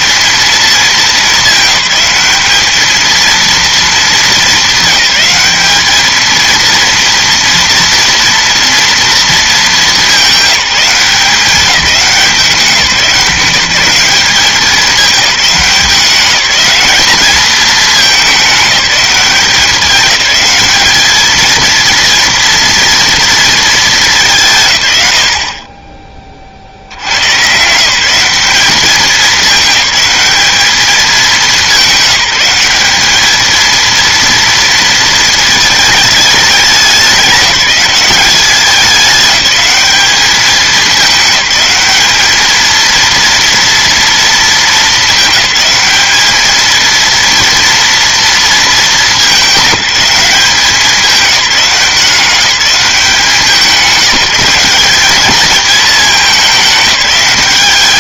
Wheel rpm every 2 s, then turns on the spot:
220, 210, 200, 230, 230, 190, 190, 200, 200, 200, 210, 230, 130, 60, 190, 200, 200, 230, 200, 200, 210, 220, 220, 220, 210, 190, 190, 190, 200.
none